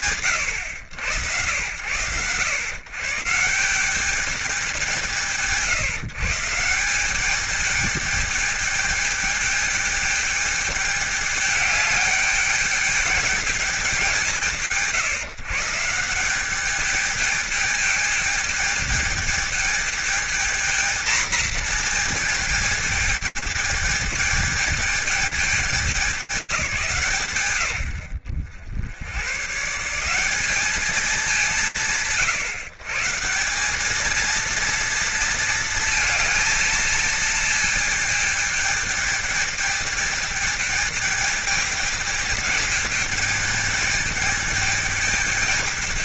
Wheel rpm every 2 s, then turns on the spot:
80, 130, 180, 180, 210, 210, 210, 160, 210, 210, 230, 220, 220, 160, 90, 180, 160, 230, 220, 210, 210, 220, 210.
none